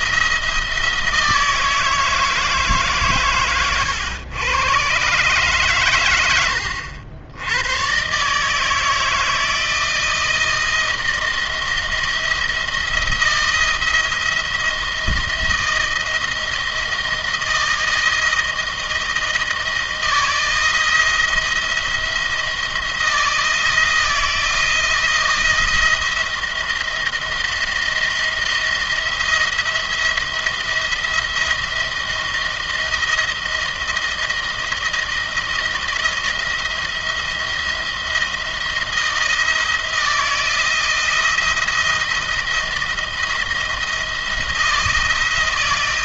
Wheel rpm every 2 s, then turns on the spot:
170, 150, 120, 70, 160, 170, 170, 160, 160, 160, 160, 160, 160, 170, 170, 170, 170, 160, 160, 170, 170, 170, 170.
none